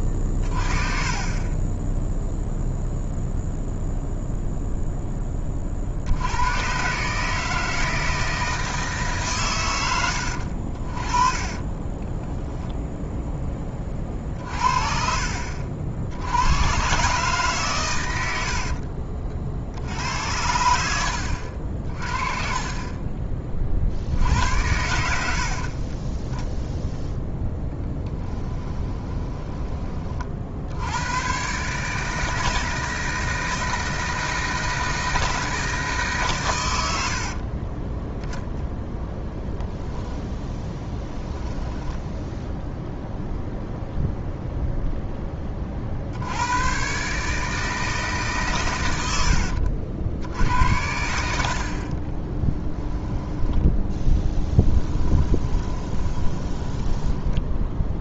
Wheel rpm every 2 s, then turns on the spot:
30, 0, 0, 120, 160, 60, 10, 50, 110, 70, 80, 30, 80, 0, 10, 70, 160, 160, 110, 0, 10, 0, 0, 100, 130, 80, 10, 10, 10.
10-12 18-20 28-30 40-42 52-58